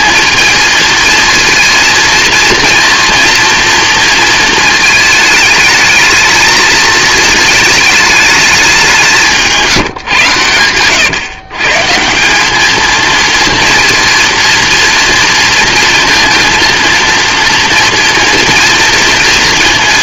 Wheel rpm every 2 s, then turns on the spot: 230, 230, 220, 220, 200, 110, 210, 230, 230, 230.
10-12